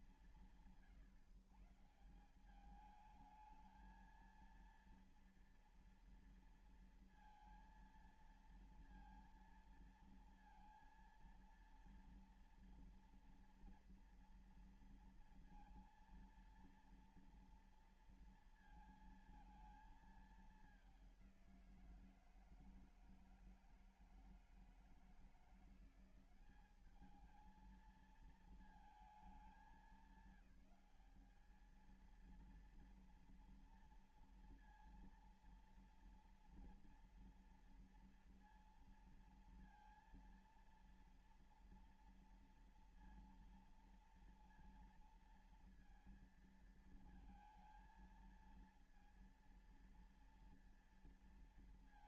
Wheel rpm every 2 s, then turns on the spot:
170, 180, 230, 230, 230, 230, 230, 230, 230, 230, 210, 170, 160, 190, 220, 190, 230, 230, 240, 230, 230, 230, 230, 220, 230, 230.
none